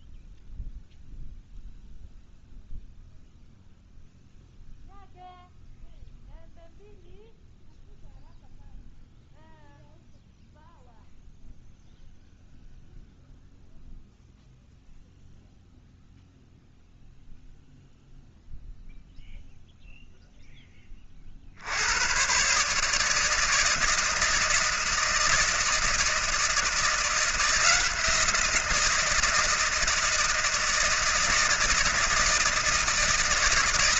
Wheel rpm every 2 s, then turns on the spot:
0, 0, 0, 0, 0, 0, 0, 0, 0, 0, 20, 150, 160, 170, 170, 160, 140.
none